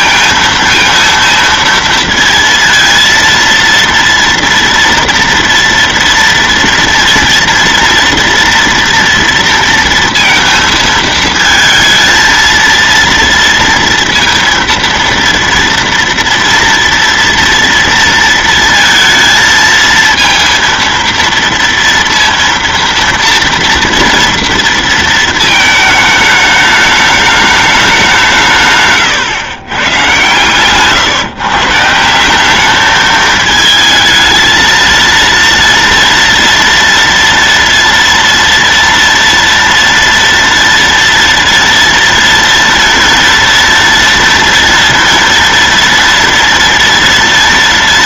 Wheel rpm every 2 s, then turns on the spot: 230, 230, 230, 230, 230, 220, 230, 230, 230, 230, 230, 230, 230, 210, 140, 130, 210, 230, 230, 230, 230, 230, 230, 230.
none